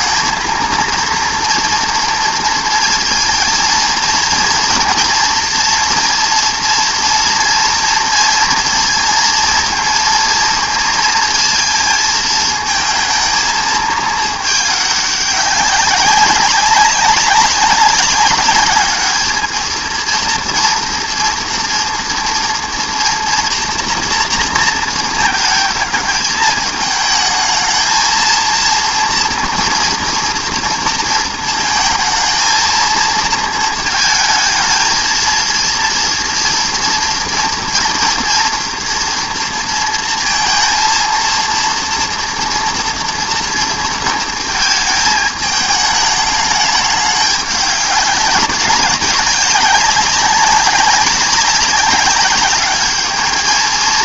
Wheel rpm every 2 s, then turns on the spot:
230, 230, 230, 230, 230, 230, 220, 210, 200, 210, 230, 230, 230, 210, 230, 230, 230, 220, 230, 230, 230, 230, 220, 210, 190, 190, 200.
none